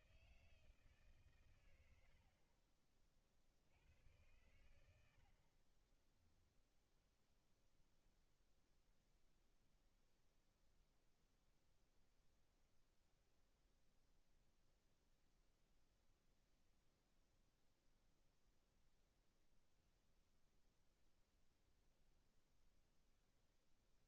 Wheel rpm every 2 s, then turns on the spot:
140, 40, 90, 0, 0, 0, 0, 0, 0, 0, 0, 0.
none